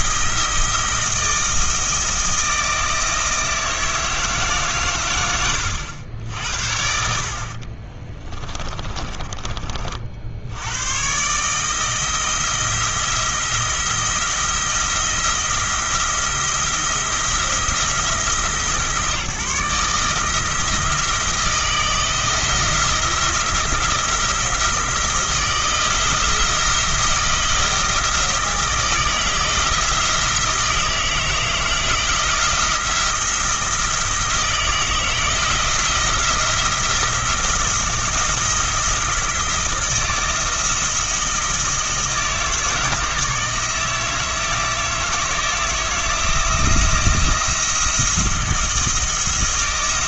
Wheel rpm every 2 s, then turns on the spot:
160, 160, 140, 60, 30, 100, 170, 170, 170, 150, 160, 160, 170, 170, 160, 160, 170, 160, 170, 170, 160, 160, 160, 170, 170.
8-10